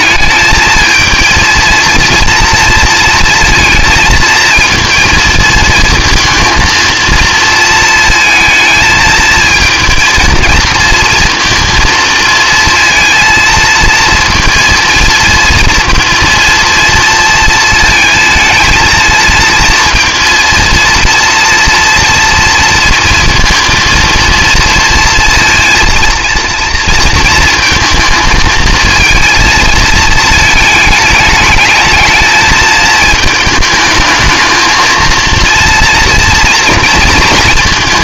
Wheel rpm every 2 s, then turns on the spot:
220, 230, 220, 230, 230, 230, 230, 230, 230, 230, 230, 230, 230, 230, 220, 220, 220, 220, 230.
none